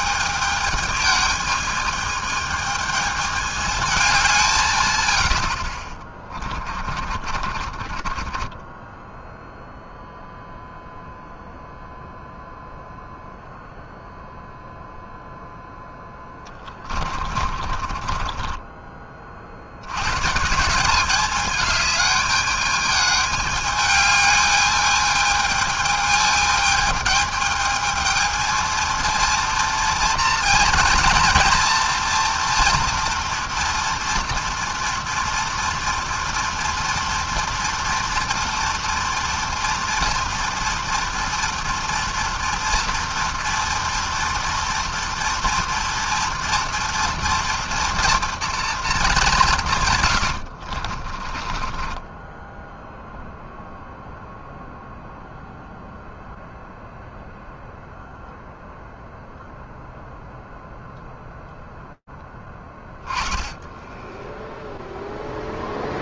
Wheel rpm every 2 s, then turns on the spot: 210, 220, 170, 30, 20, 0, 0, 0, 20, 30, 160, 210, 210, 210, 220, 230, 240, 230, 230, 230, 230, 240, 230, 230, 240, 70, 10, 0, 0, 0, 0, 20, 0.
6-10 16-20 50-54